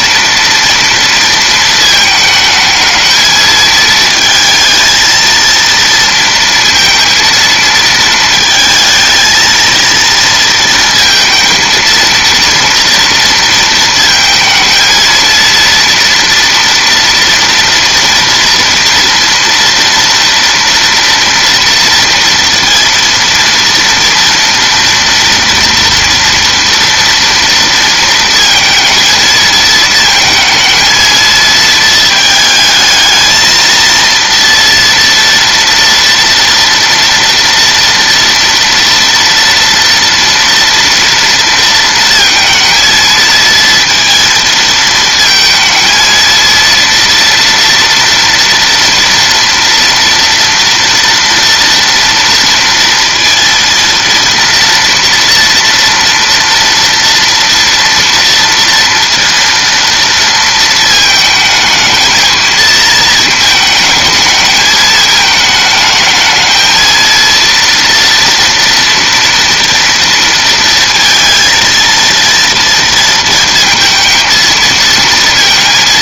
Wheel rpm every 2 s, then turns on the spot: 230, 220, 230, 230, 220, 230, 230, 230, 230, 230, 230, 230, 230, 230, 230, 230, 220, 230, 230, 230, 230, 230, 220, 230, 230, 230, 230, 230, 230, 230, 220, 230, 220, 230, 230, 230, 230, 230.
none